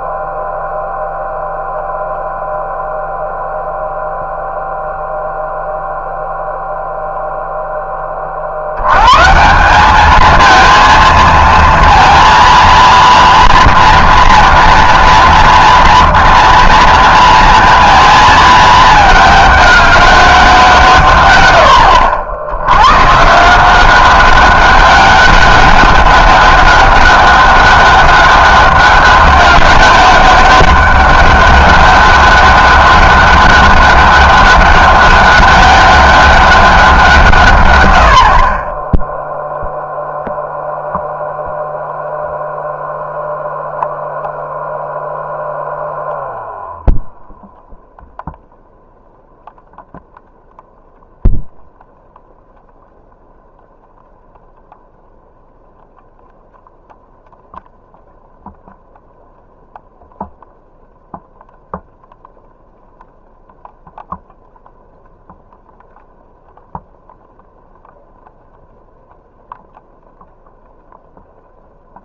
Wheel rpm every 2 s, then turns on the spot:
0, 0, 0, 0, 80, 230, 230, 230, 230, 220, 170, 100, 200, 200, 200, 200, 200, 200, 190, 30, 0, 0, 0, 0, 0, 0, 0, 0, 0, 0, 0, 0, 0, 0, 0, 0.
none